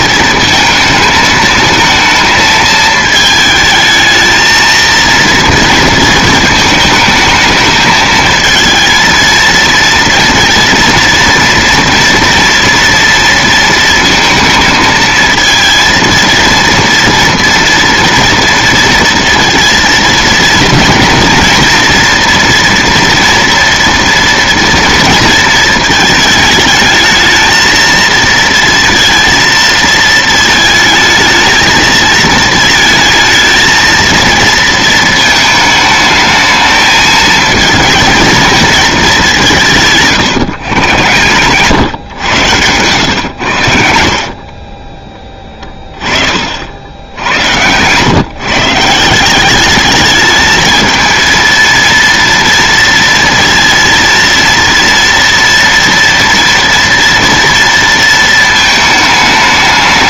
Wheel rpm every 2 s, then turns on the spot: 220, 220, 230, 230, 230, 230, 240, 230, 230, 230, 230, 240, 230, 220, 230, 220, 230, 230, 220, 220, 130, 110, 40, 60, 150, 220, 230, 230, 230, 220.
44-46